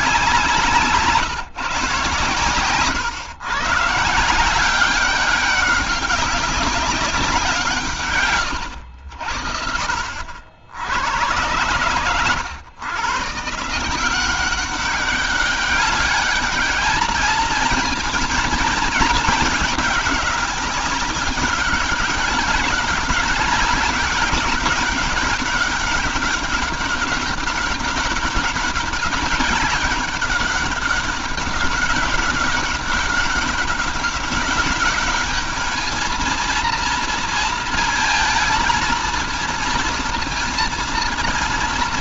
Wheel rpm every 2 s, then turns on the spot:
170, 130, 180, 200, 100, 70, 110, 190, 210, 220, 200, 200, 200, 200, 200, 200, 200, 200, 230, 230, 230.
none